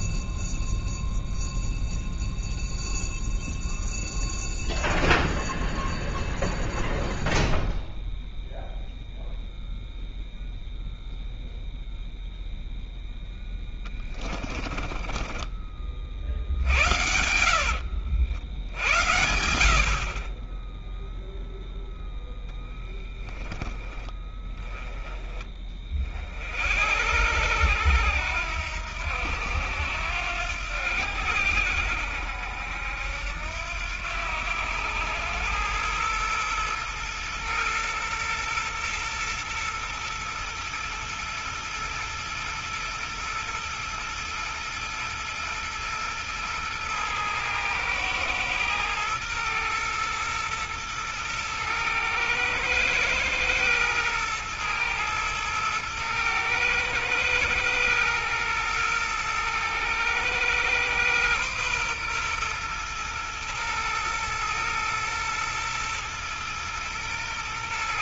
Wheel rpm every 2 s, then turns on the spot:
0, 0, 0, 0, 0, 0, 0, 30, 60, 70, 20, 10, 20, 60, 80, 80, 70, 100, 110, 110, 110, 120, 120, 110, 110, 110, 110, 110, 110, 110, 120, 120, 110, 110.
14-16